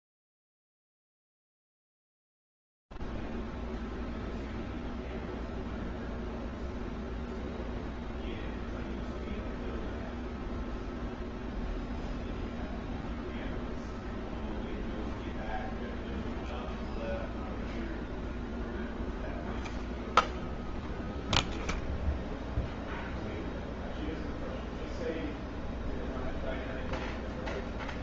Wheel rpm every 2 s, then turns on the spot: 0, 0, 0, 0, 0, 0, 0, 0, 0, 0, 0, 0, 0, 0.
none